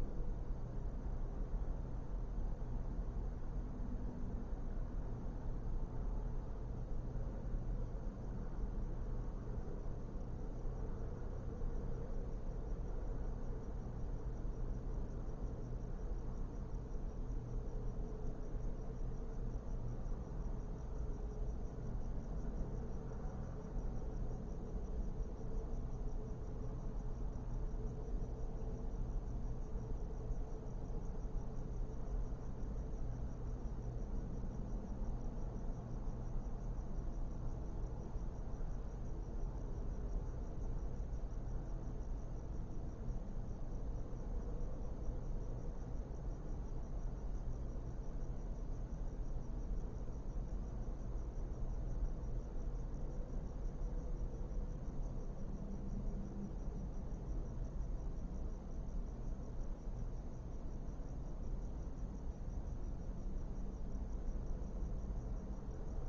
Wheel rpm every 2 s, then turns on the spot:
0, 0, 0, 0, 0, 0, 0, 0, 0, 0, 0, 0, 0, 0, 0, 0, 0, 0, 0, 0, 0, 0, 0, 0, 0, 0, 0, 0, 0, 0, 0, 0, 0.
none